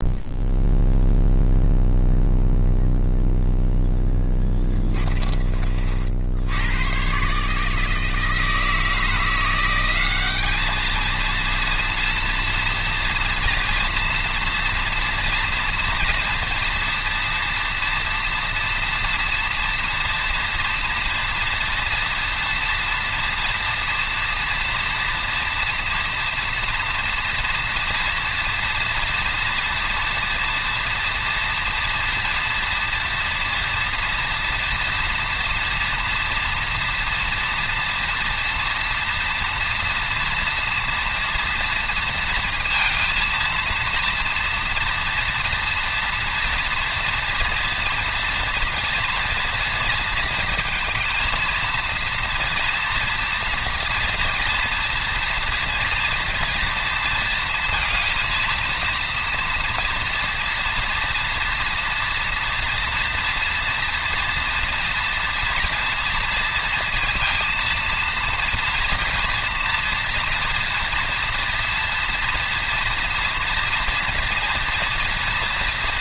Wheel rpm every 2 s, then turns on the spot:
0, 0, 20, 100, 160, 210, 230, 240, 230, 230, 230, 230, 230, 230, 230, 230, 230, 230, 230, 230, 230, 230, 240, 230, 240, 230, 230, 230, 230, 230, 240, 230, 240, 230, 240, 230, 230, 230.
4-6